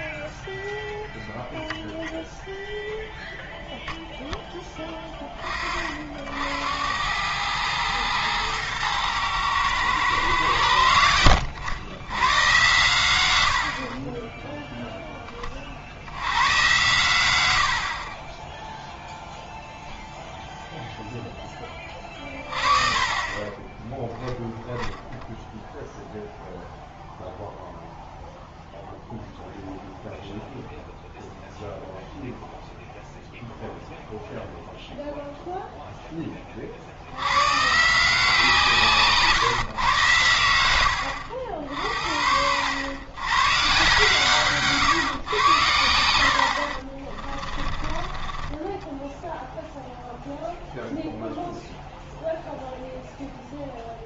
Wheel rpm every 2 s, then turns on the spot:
0, 0, 10, 70, 110, 110, 120, 0, 110, 10, 0, 30, 0, 0, 0, 0, 0, 0, 40, 160, 90, 80, 140, 60, 20, 0, 0.
46-50